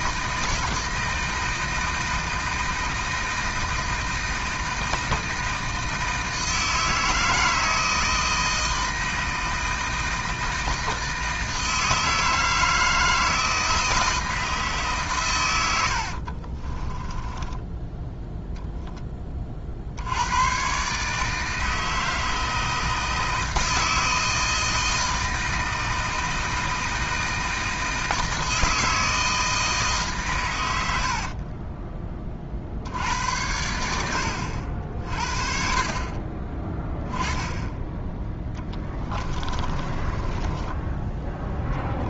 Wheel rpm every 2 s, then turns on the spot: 160, 160, 160, 160, 160, 160, 160, 140, 20, 10, 140, 160, 160, 160, 160, 90, 70, 60, 10, 20, 10.
16-18 38-42